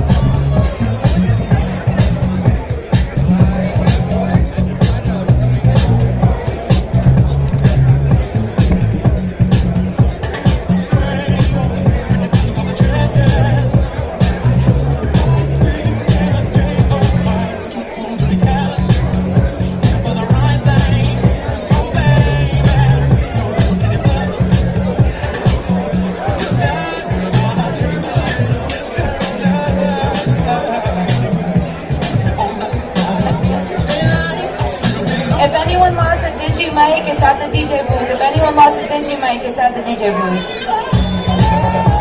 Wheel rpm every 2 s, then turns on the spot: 0, 0, 0, 0, 0, 0, 0, 0, 0, 0, 0, 0, 0, 0, 0, 0, 0, 0, 0, 0, 0.
none